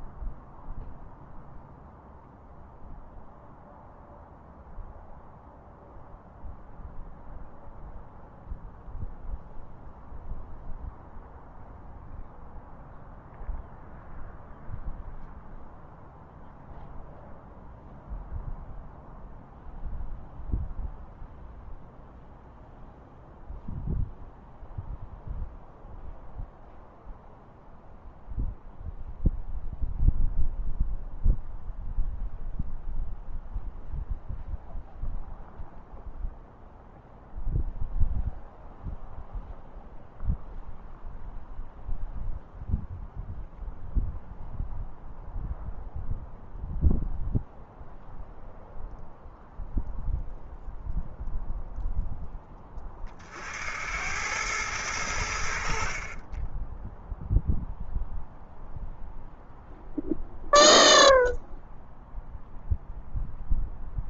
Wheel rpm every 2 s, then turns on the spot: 0, 0, 0, 0, 0, 0, 0, 0, 0, 0, 0, 0, 0, 0, 0, 0, 0, 0, 0, 0, 0, 0, 0, 0, 0, 0, 30, 100, 10, 0, 0, 0.
none